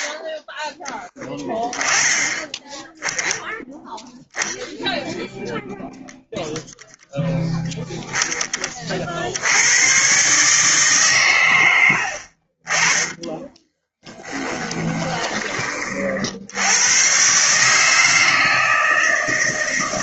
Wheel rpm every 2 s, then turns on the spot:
10, 10, 0, 0, 40, 140, 30, 20, 100, 160.
12-16